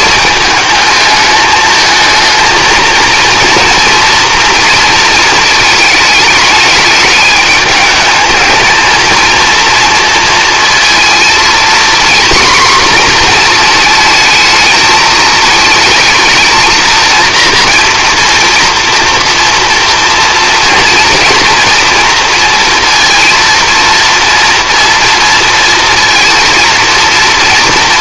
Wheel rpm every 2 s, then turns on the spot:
220, 220, 230, 210, 230, 230, 250, 220, 230, 230, 230, 230, 230, 230.
none